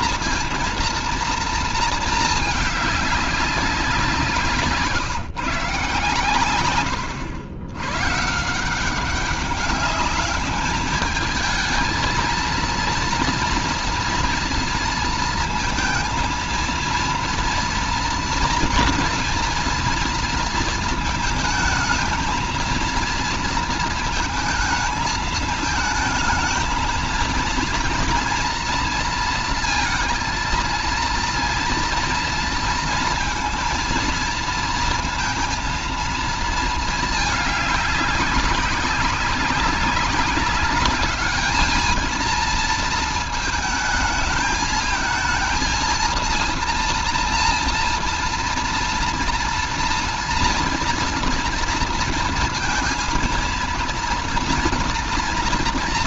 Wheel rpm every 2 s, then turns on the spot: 230, 210, 170, 100, 150, 210, 230, 230, 230, 240, 230, 230, 220, 220, 230, 230, 230, 230, 230, 200, 200, 220, 220, 230, 230, 230, 230, 230.
4-6